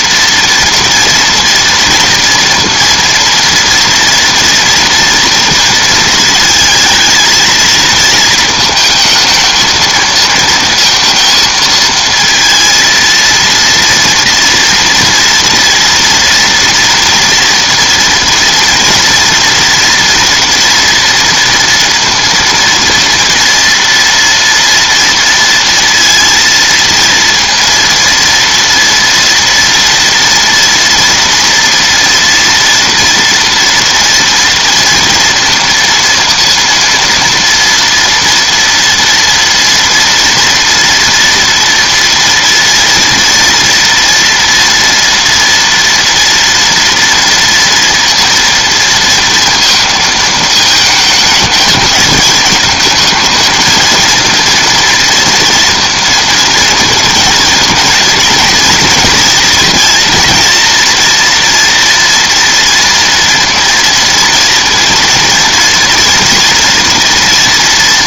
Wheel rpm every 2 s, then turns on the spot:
230, 230, 230, 230, 220, 230, 230, 230, 230, 230, 240, 230, 230, 230, 230, 230, 230, 230, 230, 230, 230, 230, 230, 230, 230, 220, 220, 240, 230, 230, 230, 230, 230, 230.
none